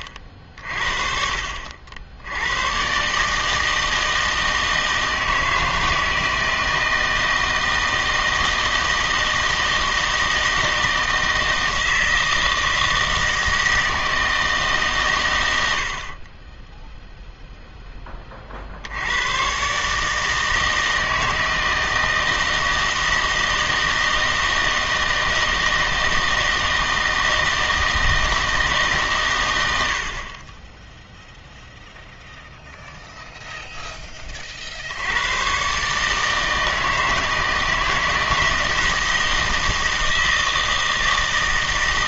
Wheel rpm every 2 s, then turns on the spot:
40, 110, 160, 160, 160, 160, 160, 150, 10, 60, 160, 160, 160, 160, 160, 30, 0, 50, 160, 160, 160.
16-18 30-32